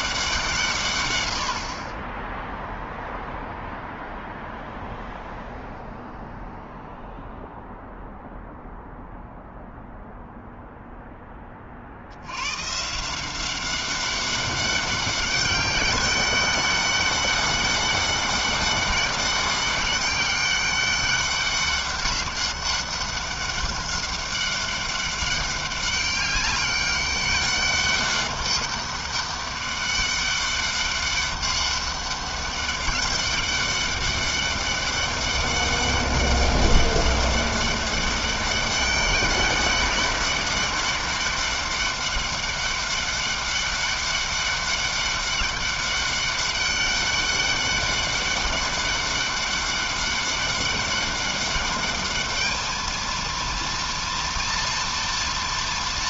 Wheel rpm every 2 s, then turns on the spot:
170, 0, 0, 0, 0, 0, 110, 200, 200, 200, 200, 200, 200, 200, 200, 200, 200, 200, 200, 200, 200, 200, 200, 200, 200, 200, 210, 230.
none